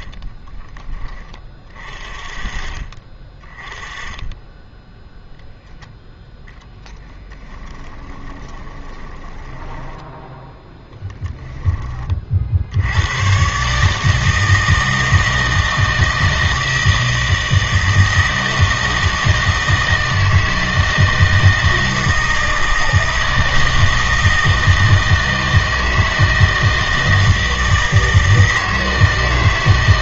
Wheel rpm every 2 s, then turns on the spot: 20, 30, 10, 10, 20, 10, 70, 160, 160, 160, 160, 160, 160, 160, 160.
8-12